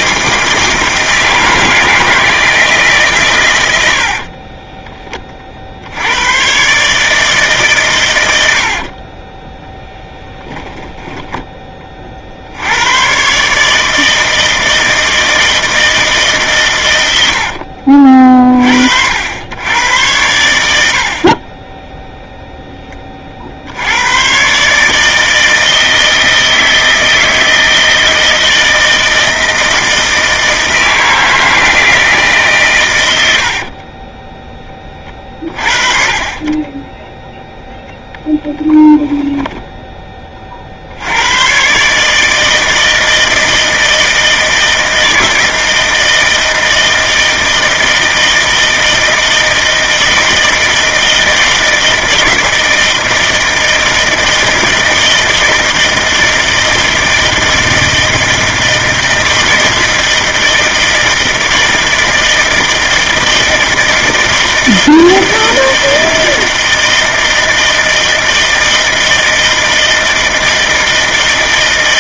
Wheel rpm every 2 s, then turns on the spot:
160, 160, 30, 130, 60, 10, 90, 160, 130, 50, 80, 10, 150, 160, 160, 160, 120, 20, 20, 0, 60, 160, 160, 160, 160, 160, 160, 160, 160, 160, 160, 160, 160, 160, 160, 160.
4-6 8-12